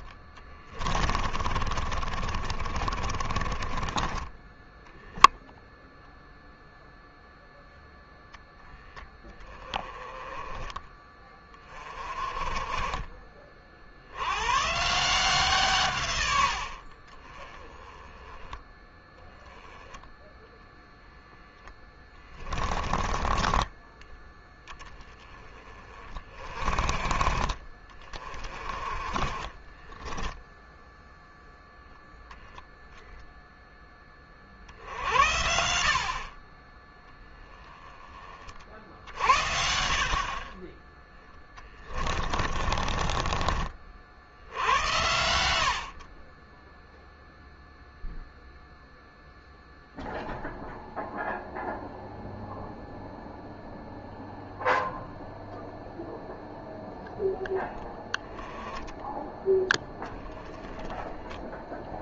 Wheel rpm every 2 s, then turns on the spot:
30, 40, 10, 0, 0, 20, 30, 150, 70, 10, 0, 20, 10, 40, 20, 10, 0, 60, 30, 50, 30, 30, 80, 0, 0, 0, 0, 0, 0, 10, 10.
0-4 42-44